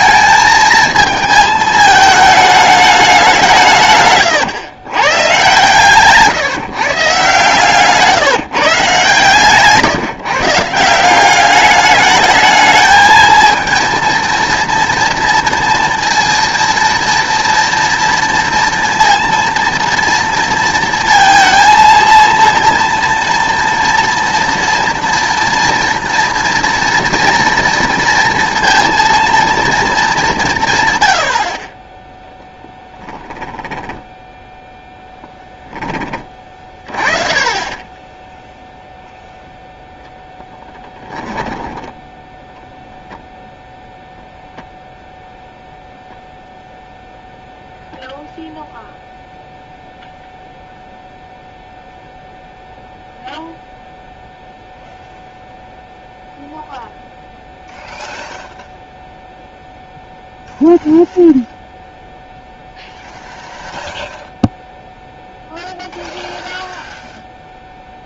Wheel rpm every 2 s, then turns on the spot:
220, 210, 120, 150, 160, 170, 220, 230, 240, 230, 230, 230, 230, 240, 230, 150, 10, 10, 30, 0, 10, 0, 0, 0, 0, 0, 0, 0, 0, 0, 0, 0, 0, 0.
32-34 40-42